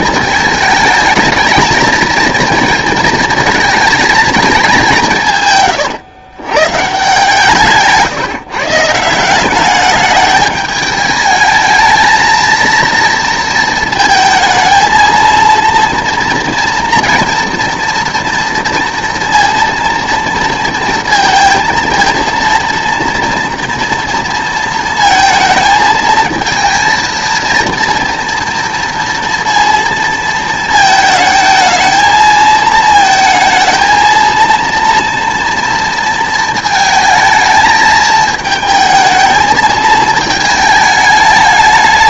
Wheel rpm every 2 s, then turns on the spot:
220, 220, 210, 140, 160, 210, 230, 220, 230, 230, 230, 230, 230, 230, 230, 220, 220, 230, 230, 220, 220.
none